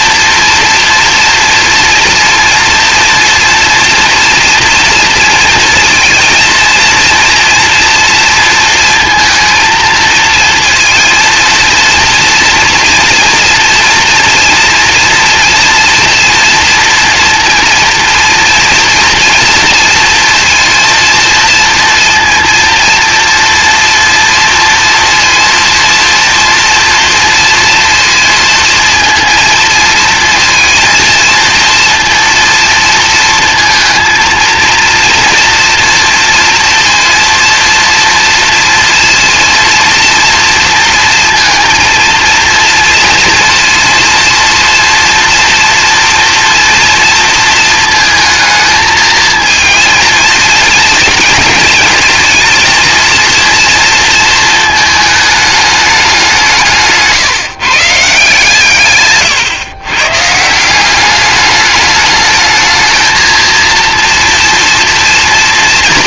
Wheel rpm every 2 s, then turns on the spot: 230, 230, 230, 230, 230, 230, 230, 230, 230, 230, 230, 230, 230, 230, 230, 230, 230, 230, 230, 230, 230, 230, 240, 240, 220, 220, 230, 220, 150, 120, 190, 220, 230.
58-60